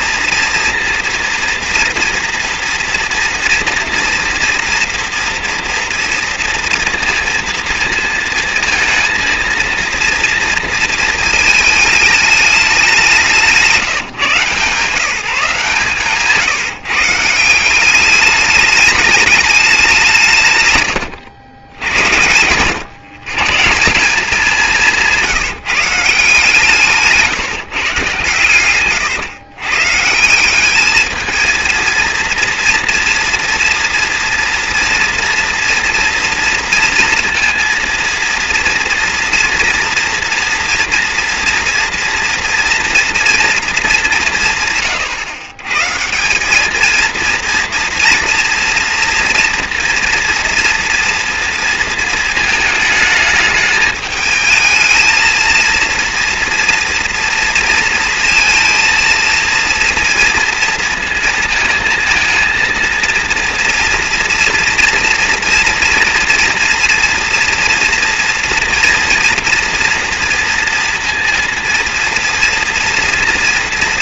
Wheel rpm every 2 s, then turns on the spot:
230, 230, 230, 230, 230, 230, 210, 150, 150, 210, 140, 120, 190, 150, 110, 200, 230, 240, 230, 230, 230, 230, 140, 210, 240, 230, 220, 220, 240, 230, 230, 220, 230, 230, 230, 230, 230.
28-30